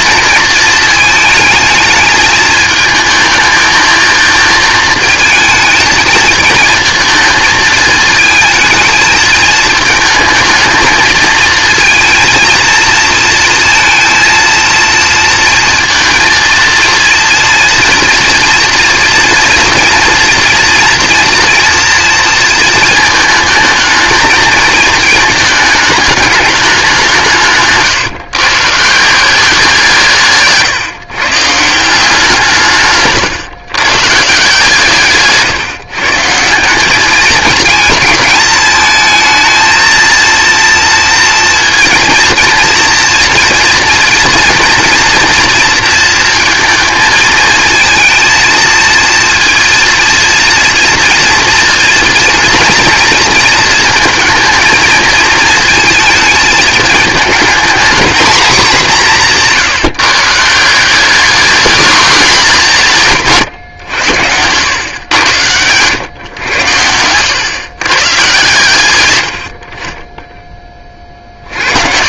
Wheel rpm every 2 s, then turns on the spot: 220, 220, 220, 220, 220, 230, 230, 230, 230, 240, 230, 220, 220, 190, 150, 140, 150, 160, 180, 220, 230, 230, 240, 220, 230, 230, 240, 230, 220, 220, 190, 180, 100, 100, 110, 30.
66-68